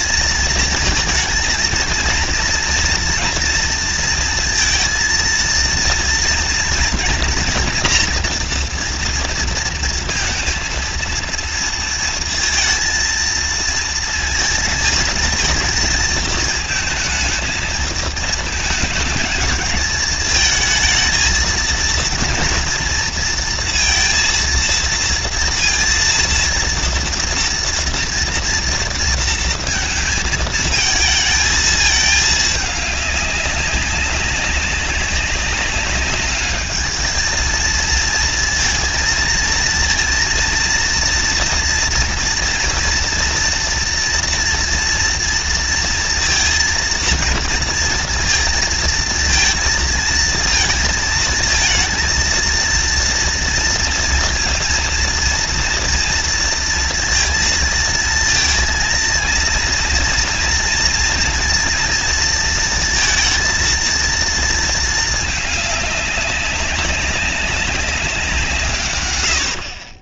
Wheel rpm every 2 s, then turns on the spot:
230, 230, 230, 230, 230, 230, 230, 220, 230, 220, 230, 230, 230, 230, 230, 220, 200, 190, 220, 230, 230, 240, 230, 230, 230, 230, 230, 230, 230, 230, 230, 230, 220, 190, 120.
none